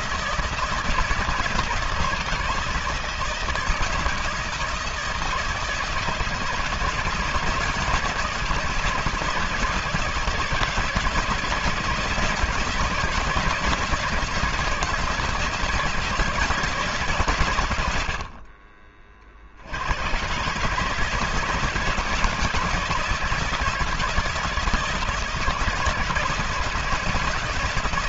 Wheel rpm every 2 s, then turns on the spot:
160, 160, 160, 160, 160, 160, 170, 170, 140, 40, 160, 160, 160, 160.
none